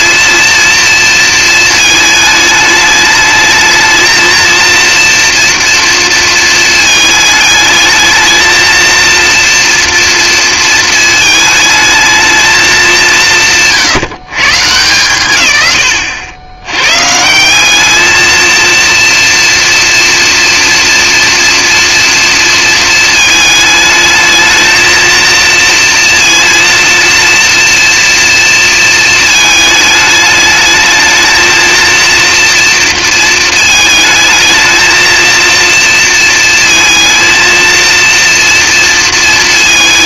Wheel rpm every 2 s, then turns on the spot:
230, 210, 230, 220, 230, 230, 210, 150, 100, 230, 230, 230, 220, 230, 230, 210, 230, 220, 220, 230.
none